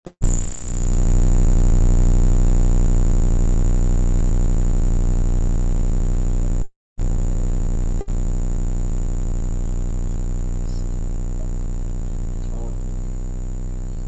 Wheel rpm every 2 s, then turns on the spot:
0, 0, 0, 0, 0, 0, 0.
none